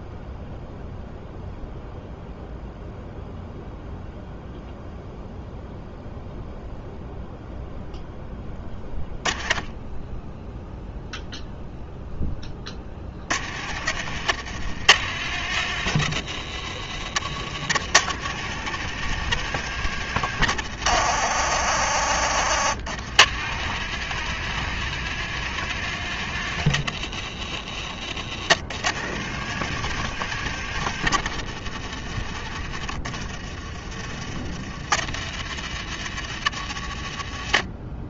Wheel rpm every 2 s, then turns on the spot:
0, 0, 0, 0, 10, 0, 20, 100, 90, 120, 80, 60, 130, 110, 90, 110, 60, 60, 70.
none